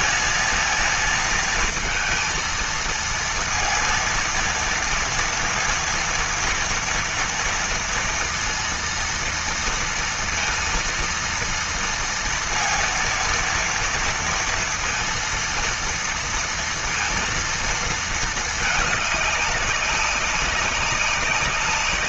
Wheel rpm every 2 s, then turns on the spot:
230, 230, 230, 230, 230, 230, 230, 230, 230, 210, 190.
none